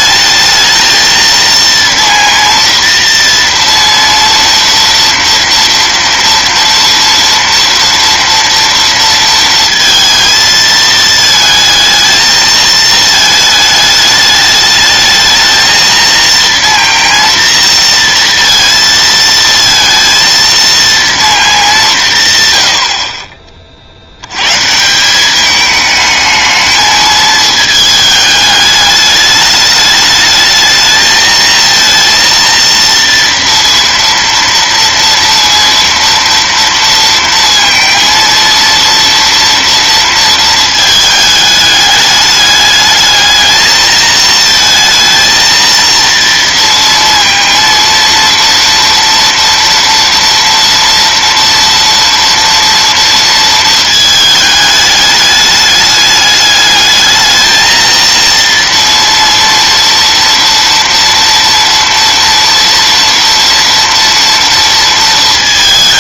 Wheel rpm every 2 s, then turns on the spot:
220, 230, 230, 230, 230, 220, 220, 220, 230, 230, 230, 70, 190, 220, 210, 220, 230, 230, 230, 230, 220, 210, 230, 230, 230, 240, 230, 210, 220, 230, 230, 230, 230.
none